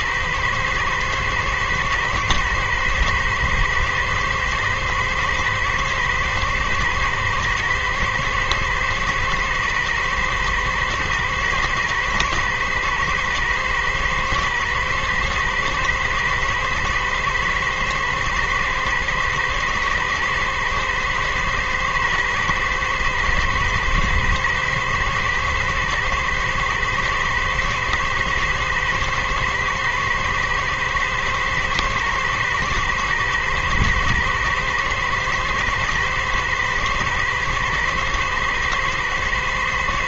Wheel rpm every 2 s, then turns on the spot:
120, 110, 110, 120, 110, 110, 110, 110, 110, 110, 110, 110, 120, 110, 110, 110, 110, 110, 110, 110.
none